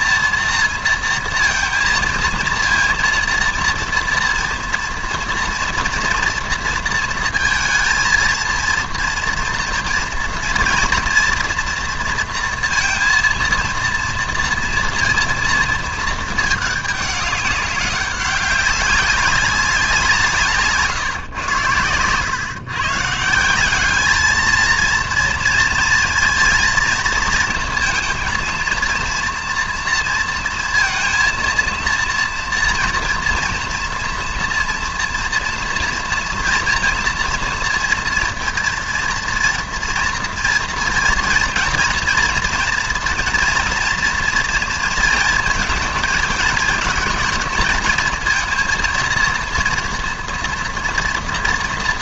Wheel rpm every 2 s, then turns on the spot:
230, 230, 230, 230, 230, 230, 230, 230, 210, 190, 150, 130, 220, 230, 230, 230, 230, 240, 230, 230, 230, 230, 230, 220, 230, 230.
none